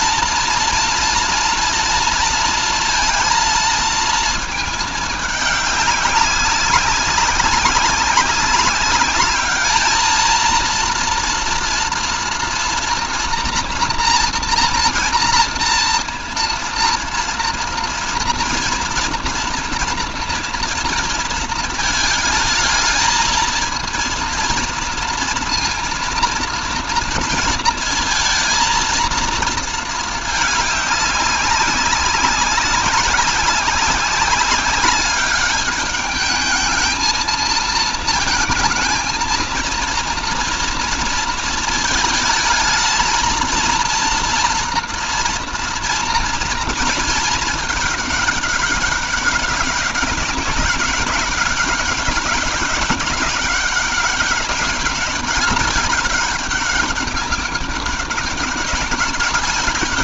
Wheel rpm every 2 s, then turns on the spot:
230, 230, 220, 190, 200, 230, 240, 230, 230, 230, 230, 220, 230, 230, 230, 200, 190, 200, 220, 230, 230, 220, 230, 230, 200, 200, 200, 200, 200, 200.
none